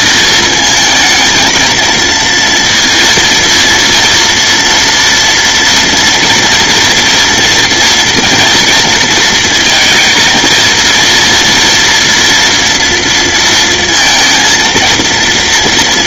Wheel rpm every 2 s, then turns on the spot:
220, 230, 230, 230, 230, 230, 230, 230.
none